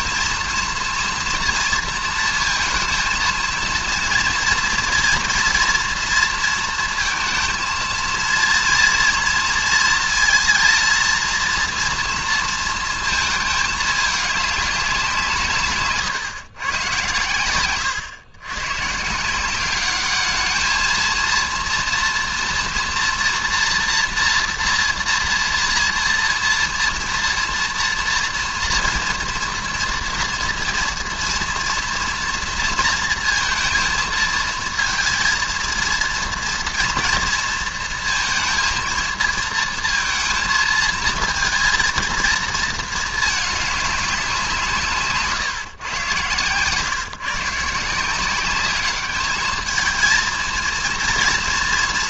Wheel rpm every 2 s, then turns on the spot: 230, 230, 230, 230, 230, 230, 230, 200, 120, 120, 220, 230, 230, 230, 230, 230, 230, 230, 230, 230, 220, 220, 160, 140, 200, 230.
none